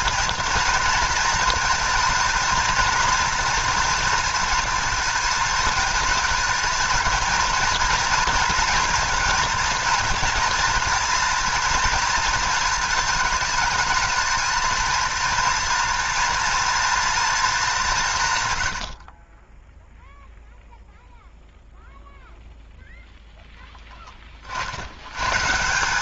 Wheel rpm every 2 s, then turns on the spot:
240, 230, 230, 230, 230, 230, 220, 230, 230, 80, 0, 0, 60.
18-20